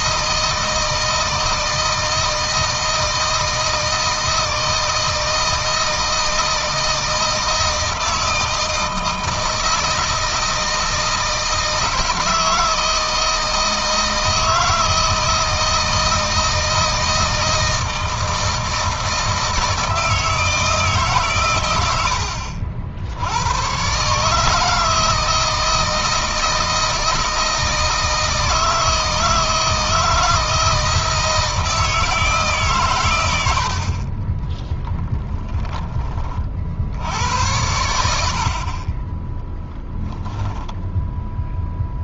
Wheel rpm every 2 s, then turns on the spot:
160, 160, 160, 160, 160, 160, 160, 160, 160, 160, 160, 70, 160, 160, 160, 160, 130, 20, 70, 40, 0.
34-36